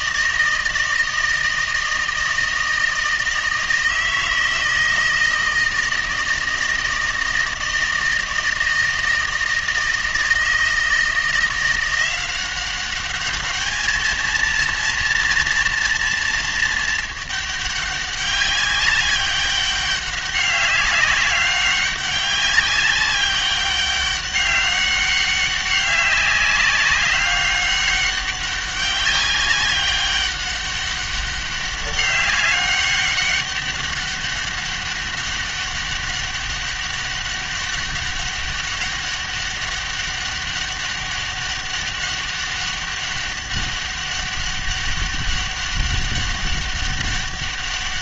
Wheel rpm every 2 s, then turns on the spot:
160, 160, 160, 160, 160, 160, 190, 230, 220, 200, 200, 200, 200, 200, 190, 200, 200, 200, 200, 200, 200, 200, 200, 200.
none